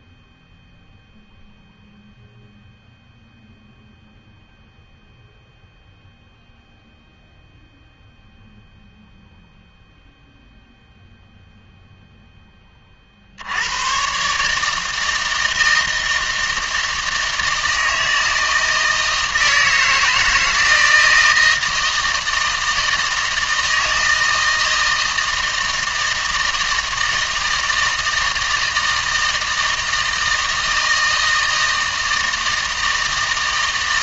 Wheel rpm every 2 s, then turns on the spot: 0, 0, 0, 0, 0, 0, 30, 160, 160, 160, 160, 160, 160, 160, 160, 160, 160.
none